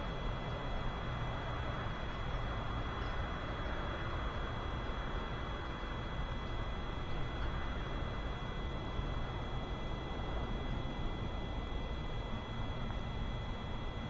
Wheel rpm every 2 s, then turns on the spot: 0, 0, 0, 0, 0, 0, 0.
none